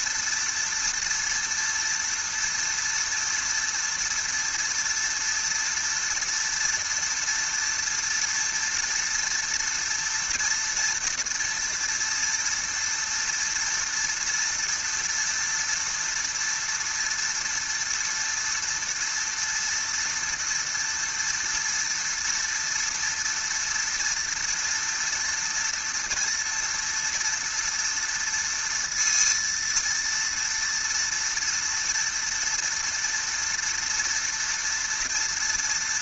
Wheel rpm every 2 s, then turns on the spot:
230, 230, 230, 240, 230, 230, 230, 230, 230, 230, 230, 230, 230, 230, 230, 230, 230, 230.
none